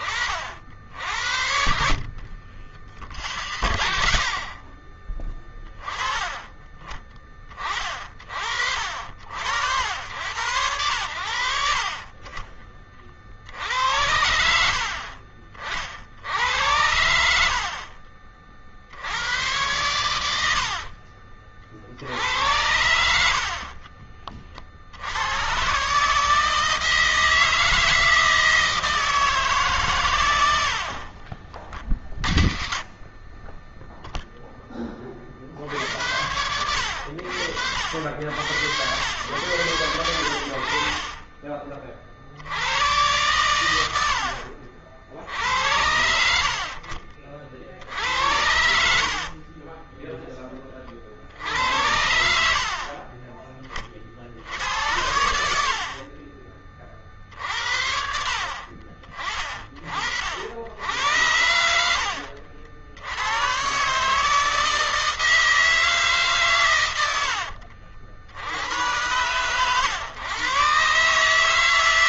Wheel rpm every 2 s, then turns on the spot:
60, 60, 20, 20, 60, 90, 50, 50, 80, 70, 50, 80, 70, 160, 160, 60, 40, 30, 80, 100, 60, 110, 60, 60, 70, 30, 50, 80, 40, 40, 80, 80, 160, 100, 110, 140.
0-2